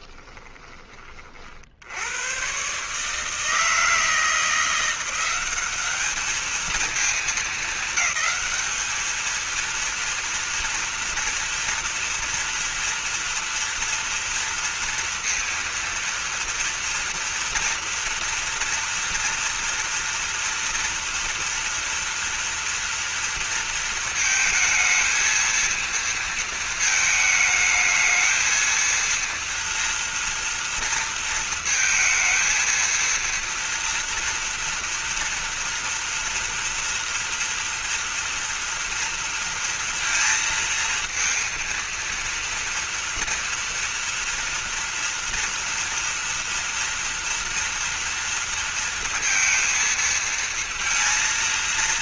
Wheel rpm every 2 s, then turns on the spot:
20, 130, 170, 220, 210, 230, 230, 230, 230, 230, 240, 230, 220, 220, 230, 230, 230, 230, 230, 230, 230, 230, 230, 230, 230, 230.
none